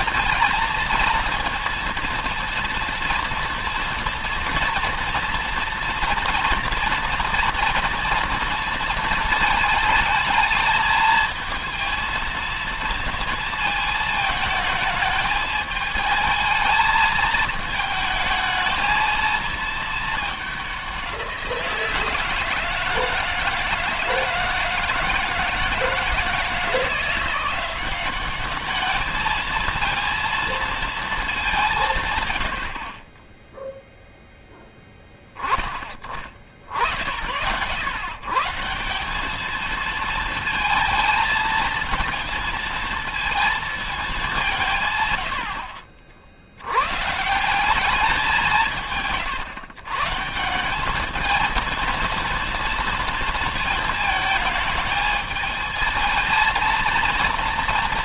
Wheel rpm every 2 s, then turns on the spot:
230, 230, 230, 240, 230, 220, 230, 220, 220, 220, 200, 160, 160, 160, 200, 230, 70, 10, 60, 150, 230, 230, 170, 80, 170, 170, 230, 220, 230.
none